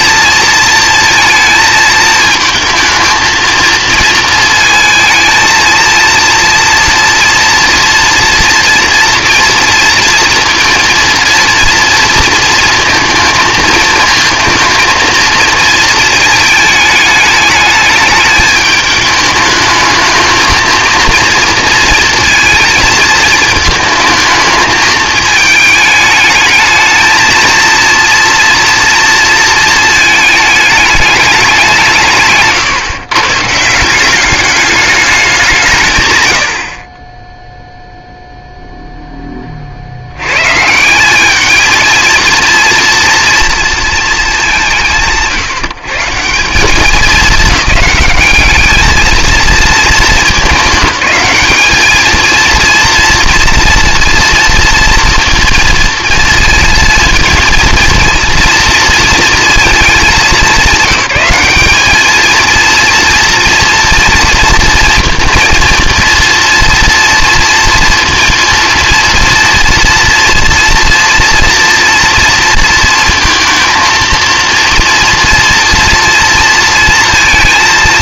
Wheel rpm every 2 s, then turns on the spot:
230, 220, 230, 230, 230, 230, 230, 230, 210, 210, 230, 230, 220, 220, 230, 210, 150, 210, 50, 0, 160, 240, 180, 190, 210, 210, 230, 230, 230, 230, 200, 220, 230, 240, 230, 230, 230, 230, 230.
none